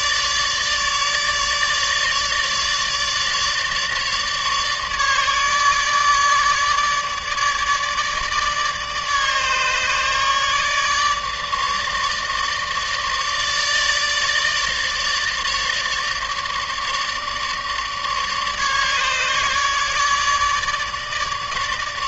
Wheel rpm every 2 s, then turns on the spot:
150, 150, 150, 150, 150, 150, 150, 150, 150, 150, 150.
none